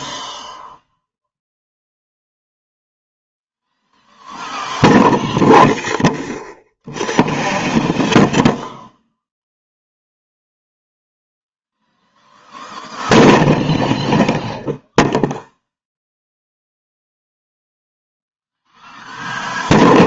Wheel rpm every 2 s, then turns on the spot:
0, 0, 0, 0, 0, 0, 0, 0, 0, 0.
none